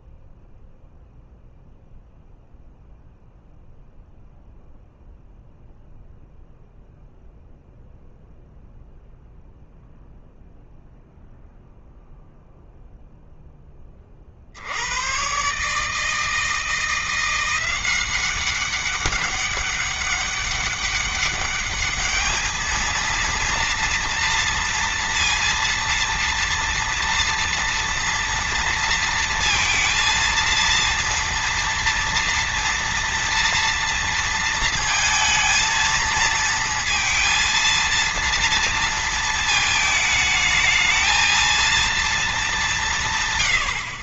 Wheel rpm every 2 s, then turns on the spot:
0, 0, 0, 0, 0, 0, 0, 100, 170, 200, 200, 220, 230, 230, 230, 230, 230, 220, 230, 230, 220, 140.
none